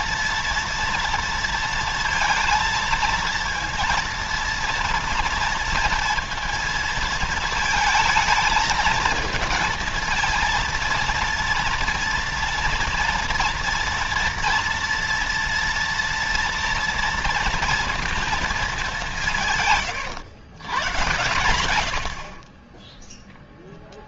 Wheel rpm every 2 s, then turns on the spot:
230, 230, 230, 230, 220, 230, 230, 230, 230, 210, 120, 30.
none